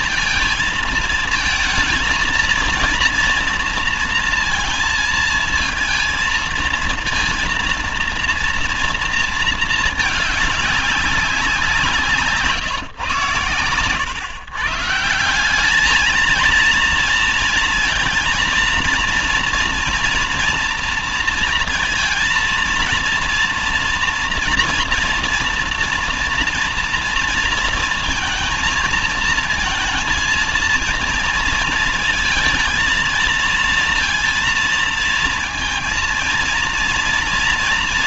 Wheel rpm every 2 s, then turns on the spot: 230, 230, 230, 230, 230, 210, 150, 150, 230, 230, 230, 220, 240, 230, 220, 230, 220, 230, 230.
none